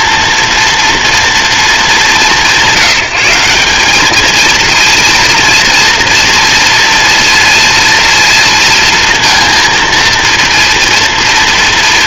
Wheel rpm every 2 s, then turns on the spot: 230, 180, 230, 230, 230, 230.
none